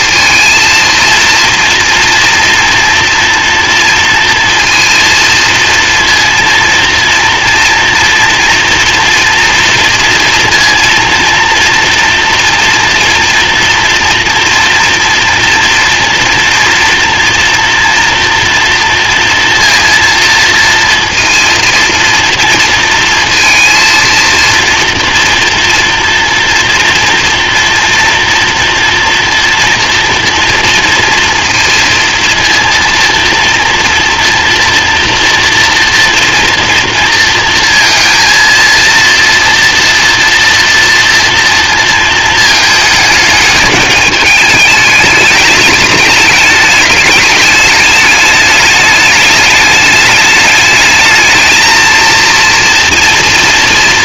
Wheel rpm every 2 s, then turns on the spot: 230, 240, 230, 230, 230, 230, 230, 240, 230, 230, 230, 230, 230, 240, 230, 230, 230, 240, 230, 230, 230, 220, 210, 210, 210, 210, 230.
none